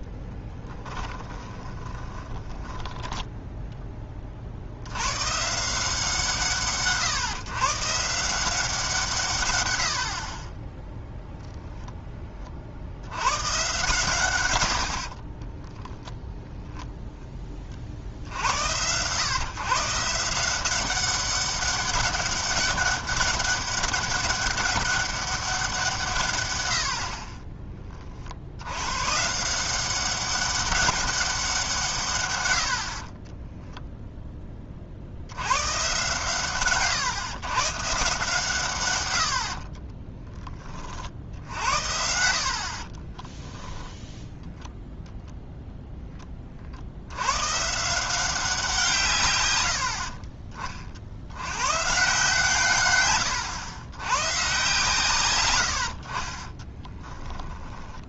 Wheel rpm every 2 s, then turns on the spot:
10, 10, 60, 150, 180, 20, 50, 80, 0, 90, 180, 200, 200, 100, 90, 200, 80, 40, 130, 140, 30, 40, 0, 40, 170, 40, 130, 130, 20.
0-4 14-16 42-44 56-58